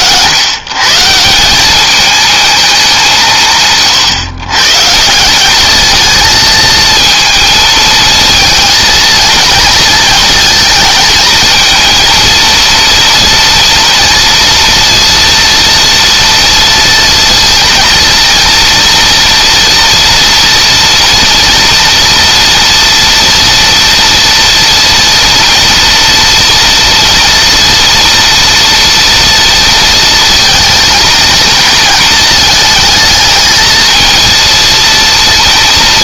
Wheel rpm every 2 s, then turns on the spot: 160, 190, 160, 230, 230, 220, 230, 230, 230, 230, 230, 230, 230, 230, 230, 220, 220, 230.
none